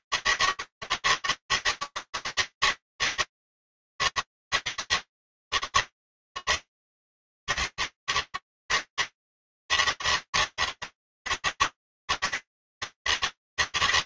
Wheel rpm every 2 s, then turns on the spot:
160, 160, 160, 160, 150, 160, 160.
none